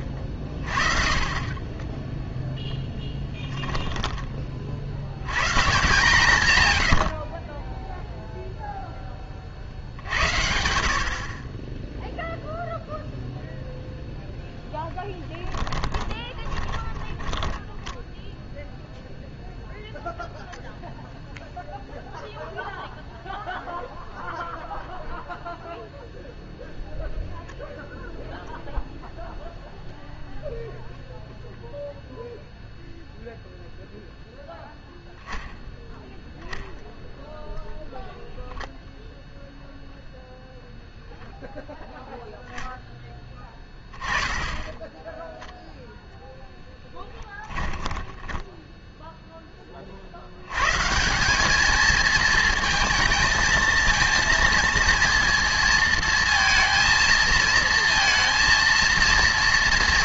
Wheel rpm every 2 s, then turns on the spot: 30, 0, 60, 90, 10, 80, 0, 20, 20, 0, 0, 0, 0, 0, 0, 0, 0, 0, 0, 0, 0, 10, 10, 10, 0, 130, 220, 230, 230, 230.
14-18 44-48